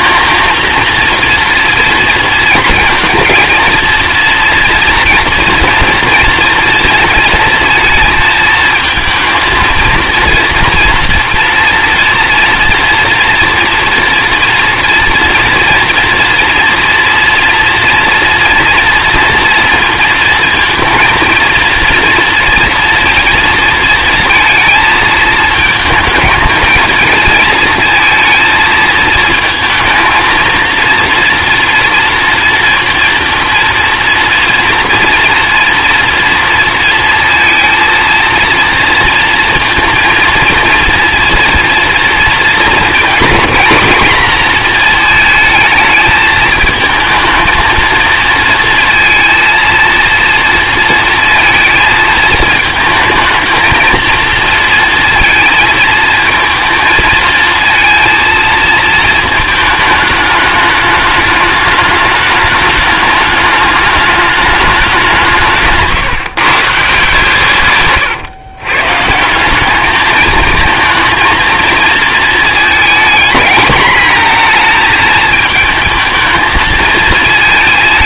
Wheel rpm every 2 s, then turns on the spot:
230, 230, 230, 230, 220, 230, 230, 230, 230, 230, 230, 230, 230, 230, 220, 230, 230, 240, 230, 230, 240, 220, 220, 230, 230, 230, 220, 230, 230, 220, 210, 210, 170, 150, 170, 220, 220, 220, 220.
none